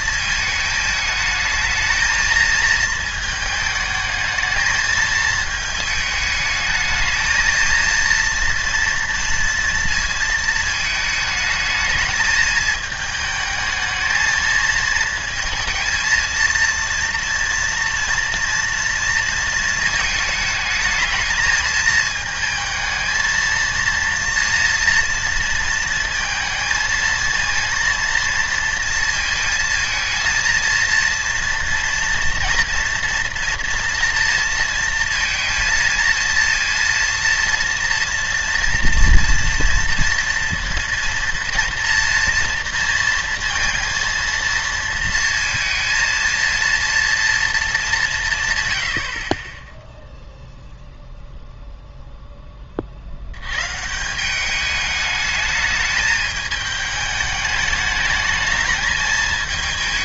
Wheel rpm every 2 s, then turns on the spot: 210, 220, 220, 210, 230, 220, 220, 220, 230, 240, 220, 220, 240, 230, 230, 230, 230, 230, 230, 230, 230, 230, 230, 230, 110, 0, 40, 210, 210, 220.
none